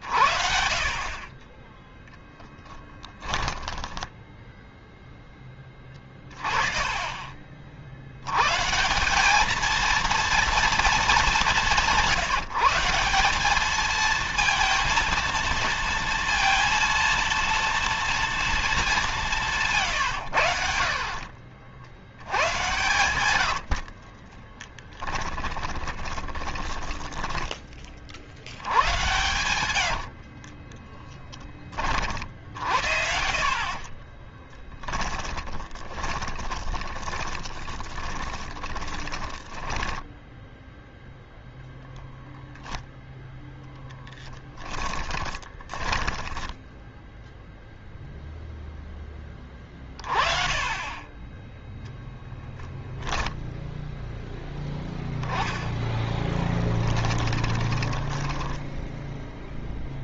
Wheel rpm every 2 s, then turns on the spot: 50, 10, 10, 20, 170, 220, 180, 230, 230, 210, 60, 110, 20, 10, 110, 20, 60, 10, 20, 20, 0, 0, 20, 0, 10, 20, 10, 10, 20, 10.
20-32 34-40 44-46 56-60